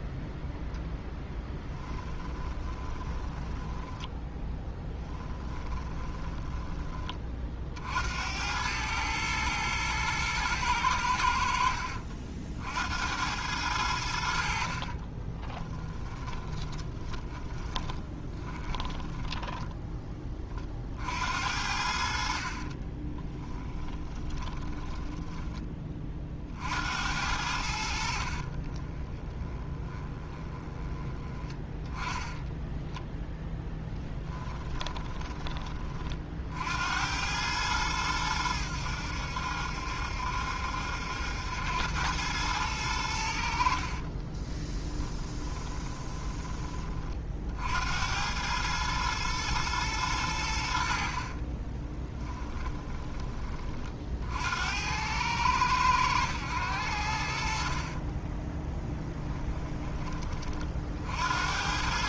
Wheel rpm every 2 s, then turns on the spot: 10, 20, 10, 30, 110, 90, 70, 40, 20, 10, 40, 40, 10, 70, 20, 20, 10, 20, 80, 90, 80, 100, 20, 30, 110, 70, 20, 80, 80, 10, 50.
2-6 14-20 22-26 28-36 44-46 52-54 58-60